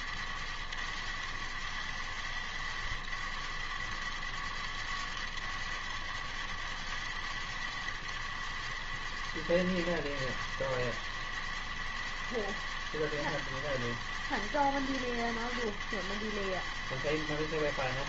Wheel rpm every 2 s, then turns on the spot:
100, 100, 100, 100, 100, 100, 100, 100, 100.
none